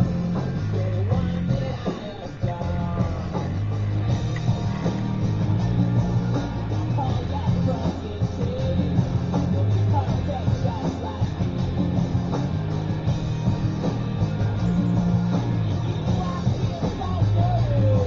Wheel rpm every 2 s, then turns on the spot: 20, 20, 0, 0, 0, 0, 0, 0, 0.
none